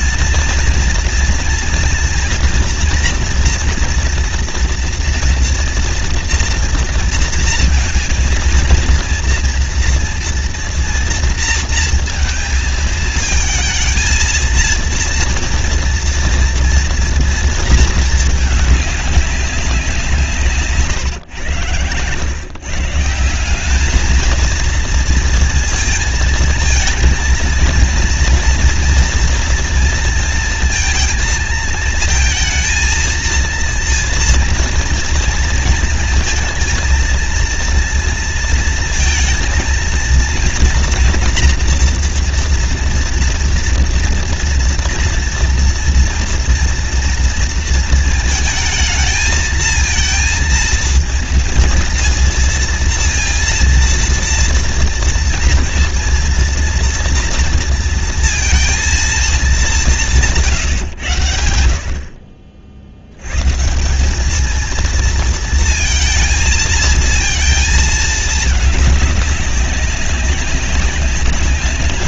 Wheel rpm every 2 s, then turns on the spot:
230, 240, 240, 230, 230, 230, 230, 230, 230, 210, 160, 130, 230, 230, 230, 230, 230, 230, 230, 230, 230, 230, 230, 230, 220, 220, 230, 230, 230, 230, 160, 60, 220, 220, 210, 190.
none